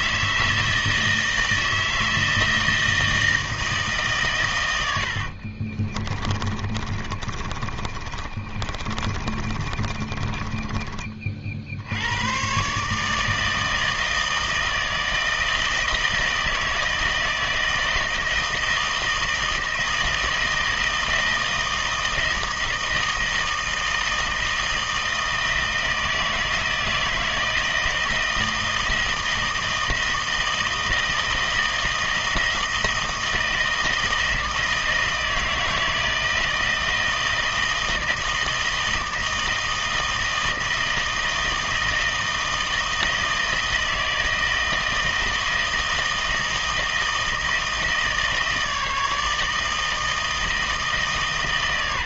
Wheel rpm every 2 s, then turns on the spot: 160, 160, 110, 30, 30, 20, 120, 160, 160, 160, 160, 160, 160, 160, 160, 160, 160, 160, 160, 160, 160, 160, 160, 160, 160, 160.
6-12